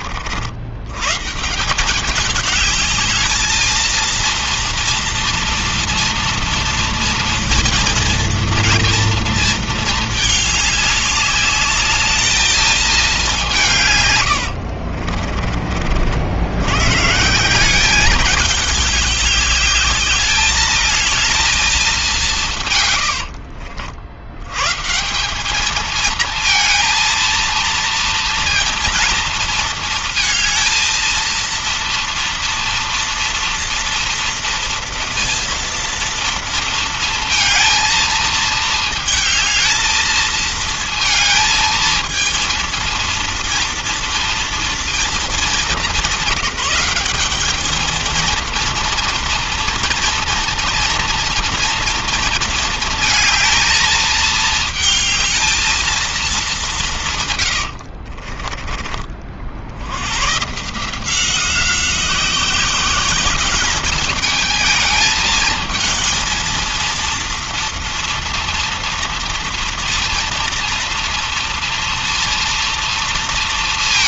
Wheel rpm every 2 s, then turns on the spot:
70, 210, 230, 230, 230, 210, 220, 80, 100, 200, 210, 160, 110, 220, 230, 230, 230, 230, 230, 220, 220, 230, 230, 190, 230, 230, 220, 220, 200, 50, 140, 180, 210, 230, 240, 230, 230.
14-16 58-60